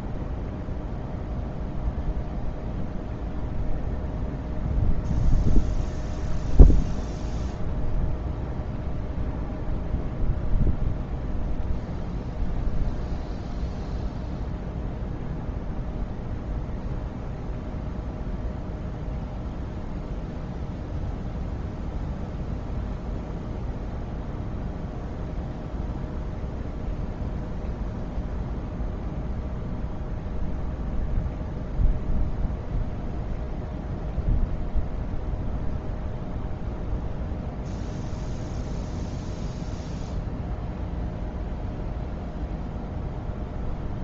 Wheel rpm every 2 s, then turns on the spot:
0, 0, 0, 0, 0, 0, 0, 0, 0, 0, 0, 0, 0, 0, 0, 0, 0, 0, 0, 0, 0, 0.
none